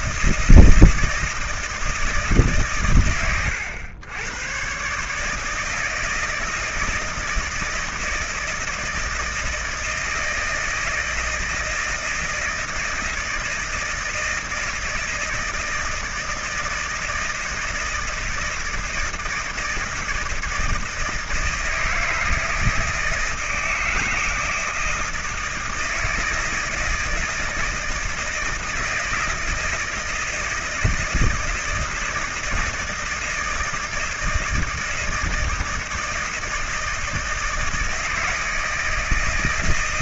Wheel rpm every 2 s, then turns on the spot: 160, 140, 120, 160, 160, 160, 160, 160, 160, 160, 160, 160, 160, 160, 160, 160, 160, 160, 160, 160.
none